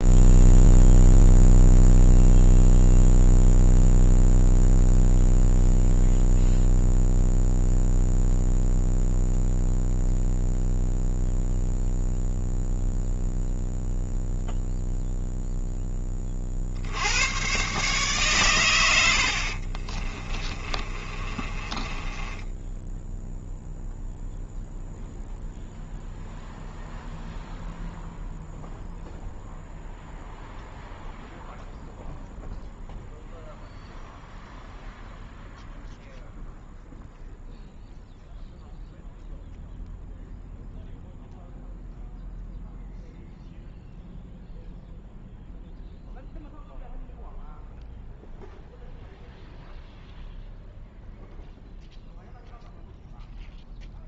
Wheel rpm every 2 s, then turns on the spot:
0, 0, 0, 0, 0, 0, 0, 0, 80, 80, 30, 0, 0, 0, 0, 0, 0, 0, 0, 0, 0, 0, 0, 0, 0, 0, 0.
20-22